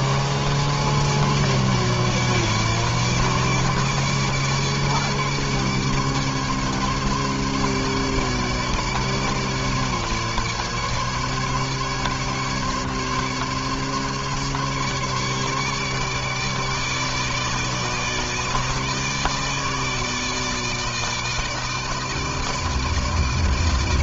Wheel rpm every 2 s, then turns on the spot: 150, 150, 150, 150, 150, 150, 140, 150, 150, 150, 160, 160.
none